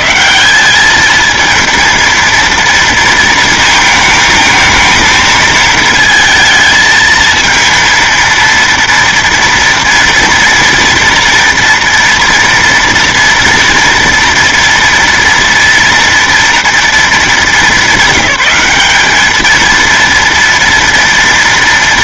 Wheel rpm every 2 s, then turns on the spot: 120, 230, 220, 220, 230, 230, 230, 230, 230, 210, 230.
none